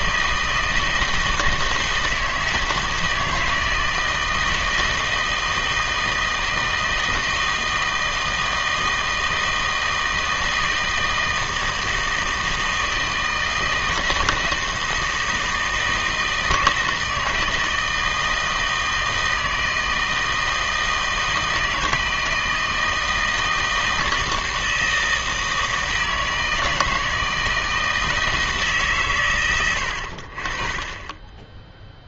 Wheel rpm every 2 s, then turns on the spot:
160, 160, 160, 160, 160, 160, 160, 160, 160, 160, 160, 160, 160, 160, 150, 30.
none